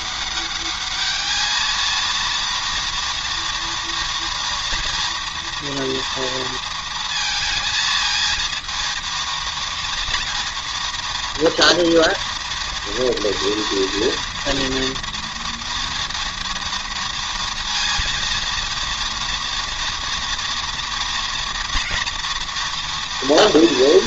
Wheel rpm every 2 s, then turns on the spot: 210, 230, 230, 230, 230, 230, 230, 230, 230, 230, 230, 240.
none